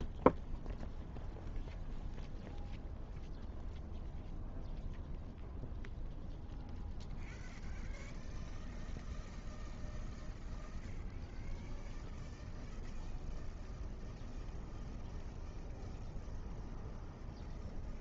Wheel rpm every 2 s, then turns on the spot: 0, 0, 0, 0, 0, 0, 0, 0, 0.
none